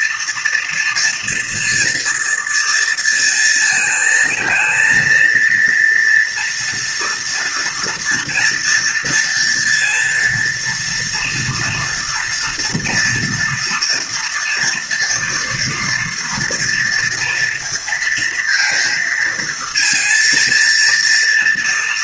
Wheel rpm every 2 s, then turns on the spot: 230, 230, 230, 230, 230, 240, 230, 230, 230, 230, 230.
none